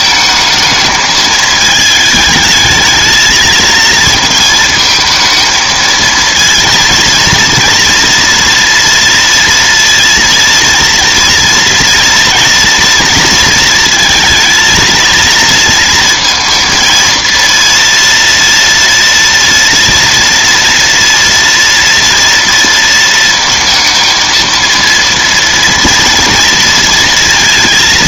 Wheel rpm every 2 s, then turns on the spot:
220, 220, 220, 230, 230, 230, 240, 220, 230, 230, 230, 230, 230, 230.
none